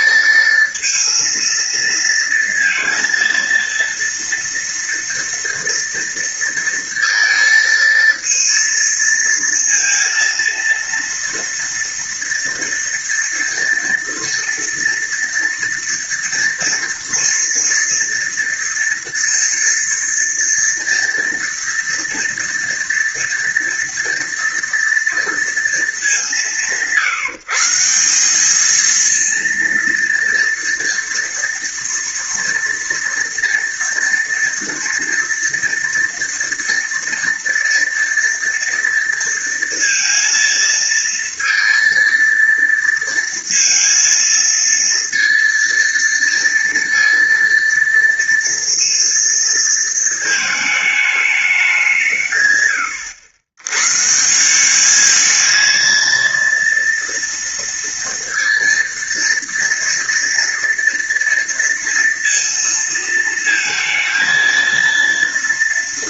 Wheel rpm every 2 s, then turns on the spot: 230, 230, 230, 230, 230, 230, 230, 230, 230, 230, 230, 230, 230, 160, 210, 230, 230, 230, 230, 230, 230, 230, 230, 230, 230, 220, 120, 190, 230, 230, 230, 230, 230.
none